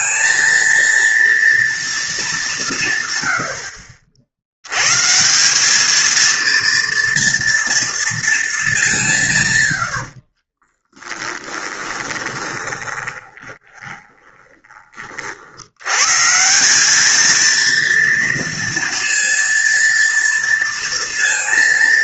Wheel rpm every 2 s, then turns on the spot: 230, 180, 90, 230, 210, 30, 20, 20, 180, 230, 230.
10-14